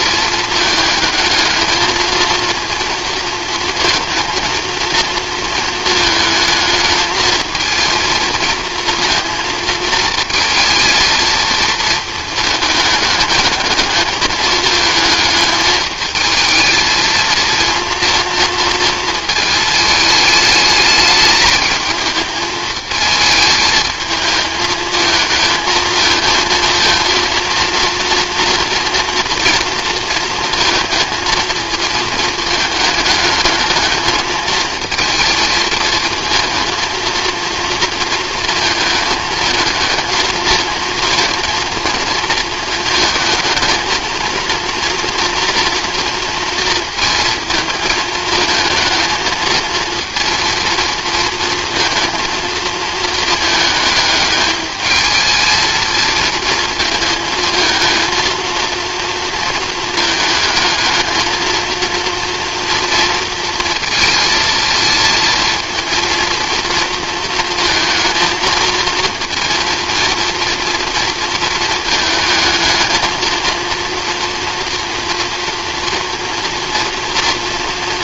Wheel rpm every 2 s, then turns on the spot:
220, 230, 230, 220, 230, 220, 220, 220, 220, 230, 210, 220, 220, 230, 230, 220, 220, 230, 220, 220, 230, 230, 230, 230, 220, 230, 220, 220, 220, 230, 220, 230, 230, 230, 230, 230, 220, 240, 230.
none